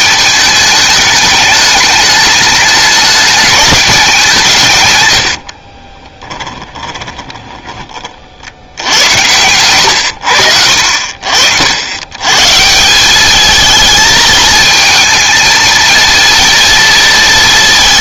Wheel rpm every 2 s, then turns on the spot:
210, 210, 140, 20, 70, 70, 160, 220, 230.
6-10